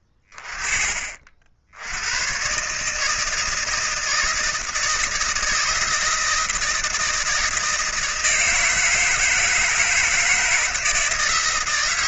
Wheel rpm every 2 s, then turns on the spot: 70, 160, 170, 160, 160, 160.
none